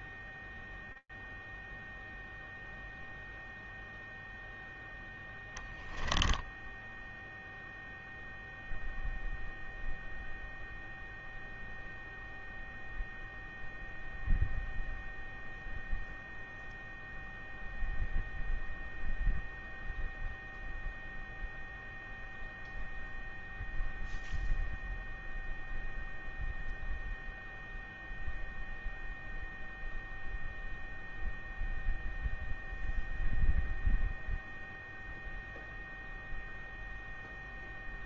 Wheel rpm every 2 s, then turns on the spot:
0, 10, 0, 0, 0, 0, 0, 0, 0, 0, 0, 0, 0, 0, 0, 0, 0, 0, 0.
2-4